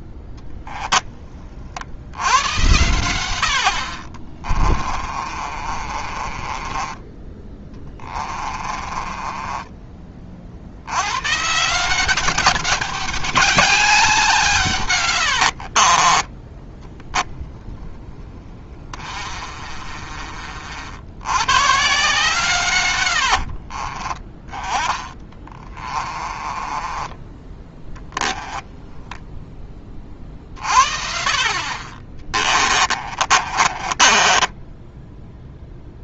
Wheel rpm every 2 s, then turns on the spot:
20, 100, 30, 20, 30, 80, 200, 130, 10, 30, 60, 120, 20, 20, 10, 50, 30, 10.
4-10 16-20 22-28 32-36